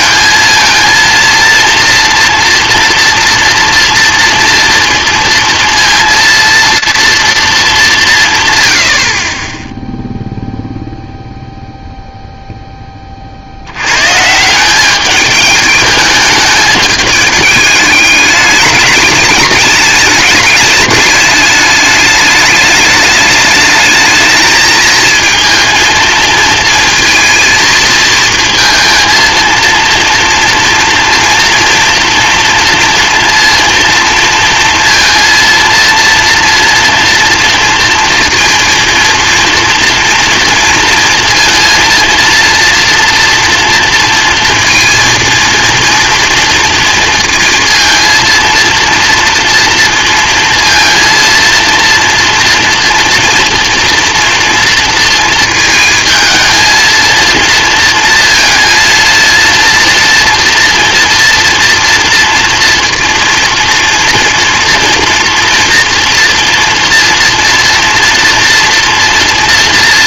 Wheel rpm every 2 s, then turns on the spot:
230, 240, 230, 230, 110, 0, 0, 170, 210, 210, 210, 210, 220, 230, 220, 230, 230, 230, 230, 230, 230, 230, 230, 230, 230, 230, 230, 230, 220, 230, 240, 230, 230, 230, 230.
none